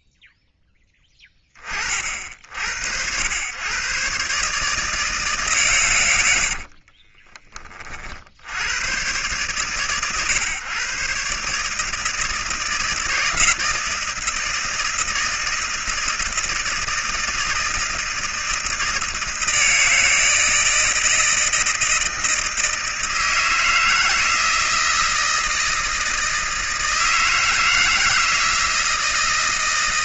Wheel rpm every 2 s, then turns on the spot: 10, 80, 150, 20, 110, 130, 160, 160, 160, 160, 160, 160, 160, 160, 160.
6-8